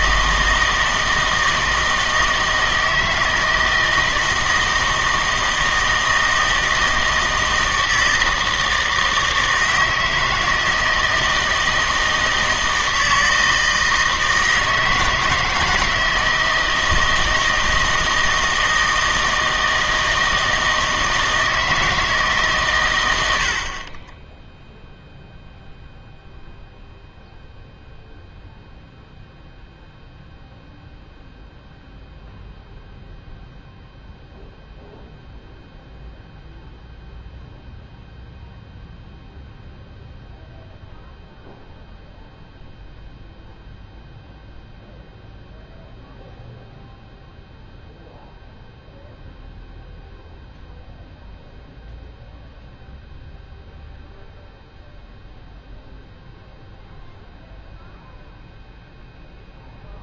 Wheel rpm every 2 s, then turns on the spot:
160, 160, 160, 160, 160, 160, 160, 160, 160, 160, 160, 140, 0, 0, 0, 0, 0, 0, 0, 0, 0, 0, 0, 0, 0, 0, 0, 0, 0, 0.
none